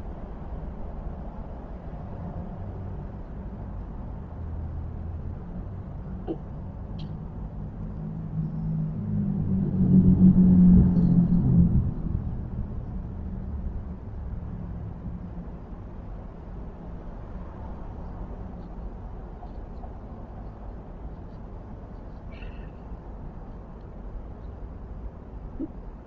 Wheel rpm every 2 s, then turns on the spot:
0, 0, 0, 0, 0, 0, 0, 0, 0, 0, 0, 0, 0.
none